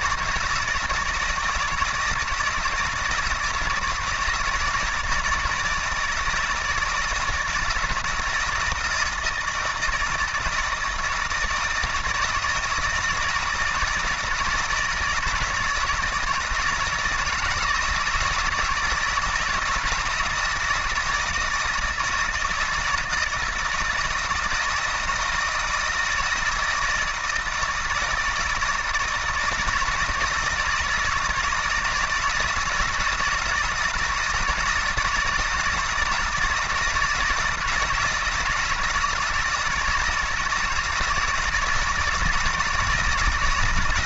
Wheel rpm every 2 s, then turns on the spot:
170, 160, 160, 160, 160, 160, 160, 160, 170, 160, 160, 160, 160, 170, 160, 160, 160, 170, 160, 160, 160, 160.
none